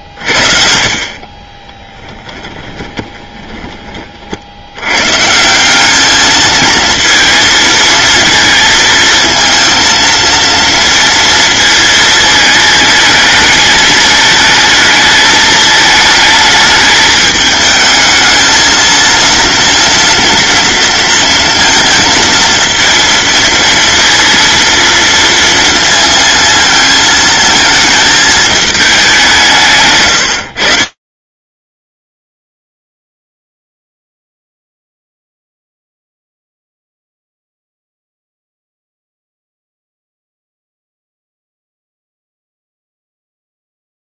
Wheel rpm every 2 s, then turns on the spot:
50, 10, 90, 230, 220, 230, 220, 220, 210, 230, 230, 220, 230, 230, 210, 50, 0, 0, 0, 0, 0, 0.
2-4